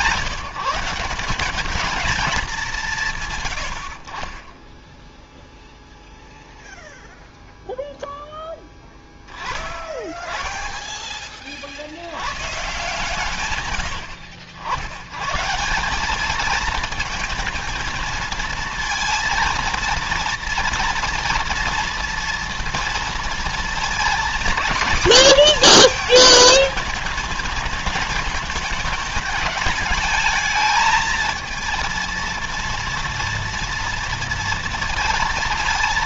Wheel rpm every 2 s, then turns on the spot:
160, 190, 20, 0, 10, 20, 120, 100, 220, 230, 230, 230, 240, 220, 220, 220, 230, 230.
10-12